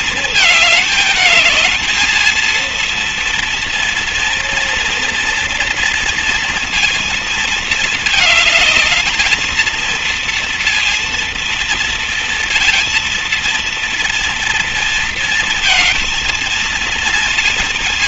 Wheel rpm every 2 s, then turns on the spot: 220, 230, 230, 230, 220, 230, 230, 240, 230.
none